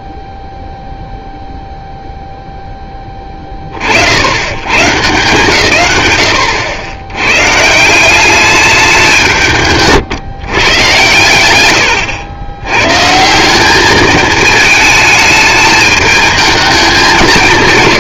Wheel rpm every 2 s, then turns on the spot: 0, 20, 160, 130, 150, 110, 170, 220, 210.
none